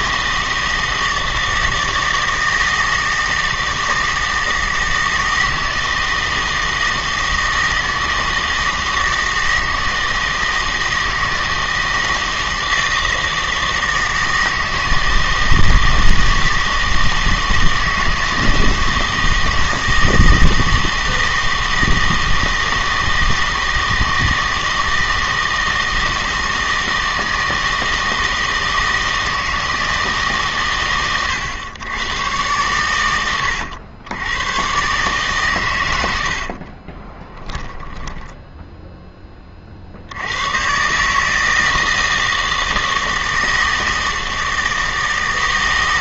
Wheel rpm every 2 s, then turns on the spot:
160, 160, 160, 160, 160, 160, 160, 160, 160, 160, 160, 160, 160, 160, 160, 130, 110, 130, 40, 10, 130, 160, 160.
36-38